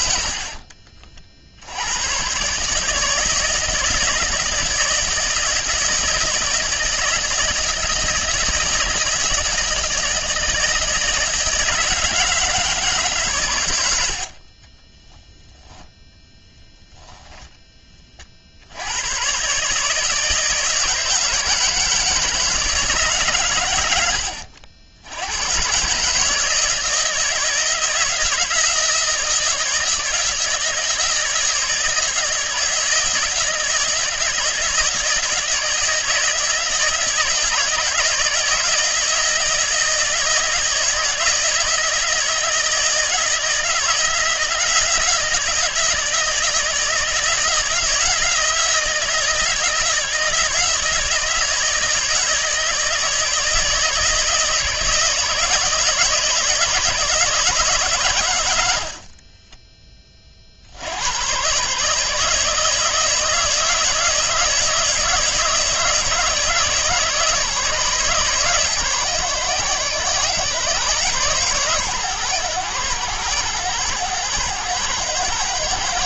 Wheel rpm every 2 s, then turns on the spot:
40, 150, 160, 160, 160, 160, 150, 20, 10, 100, 160, 150, 80, 160, 160, 160, 160, 160, 160, 160, 160, 160, 170, 160, 170, 160, 160, 160, 160, 50, 90, 160, 160, 150, 130, 130, 110, 110.
14-16